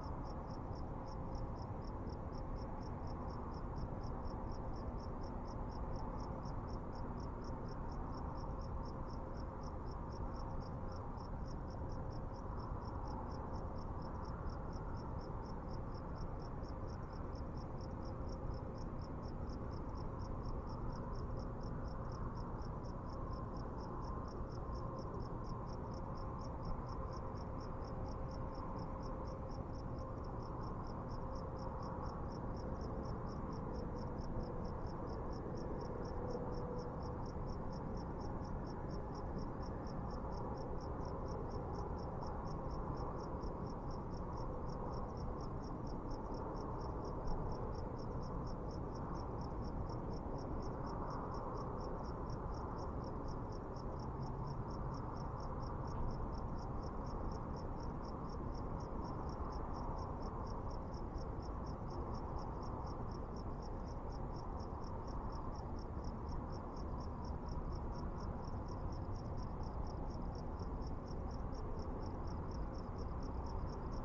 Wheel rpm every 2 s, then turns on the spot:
0, 0, 0, 0, 0, 0, 0, 0, 0, 0, 0, 0, 0, 0, 0, 0, 0, 0, 0, 0, 0, 0, 0, 0, 0, 0, 0, 0, 0, 0, 0, 0, 0, 0, 0, 0, 0.
none